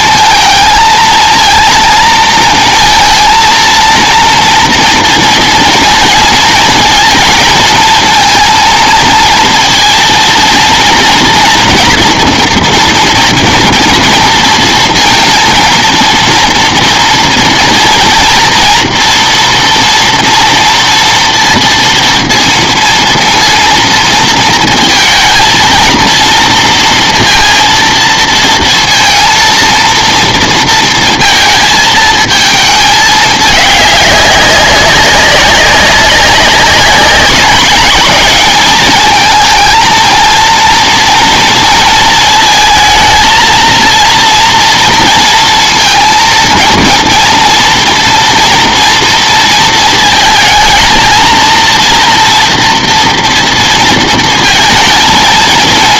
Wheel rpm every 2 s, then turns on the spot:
230, 230, 230, 230, 230, 230, 230, 230, 230, 230, 230, 230, 220, 230, 230, 230, 220, 190, 190, 210, 230, 220, 230, 230, 230, 220, 240, 230.
none